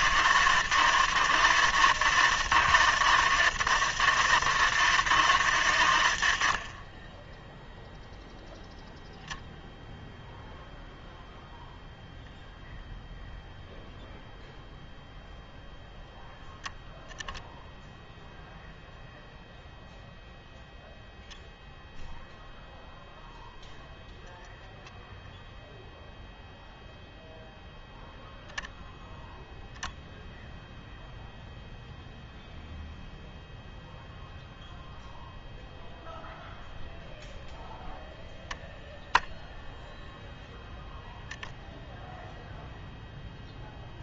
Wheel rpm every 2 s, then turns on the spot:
160, 150, 150, 90, 0, 0, 0, 0, 0, 0, 0, 0, 0, 0, 0, 0, 0, 0, 0, 10, 10, 0.
38-42